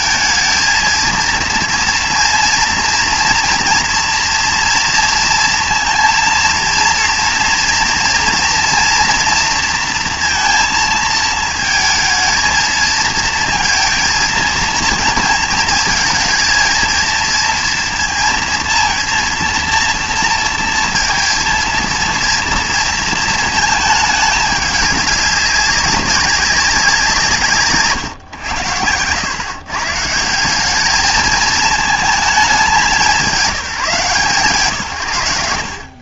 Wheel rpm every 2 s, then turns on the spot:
230, 230, 230, 230, 240, 230, 220, 230, 220, 230, 230, 230, 210, 190, 100, 190, 200, 130.
none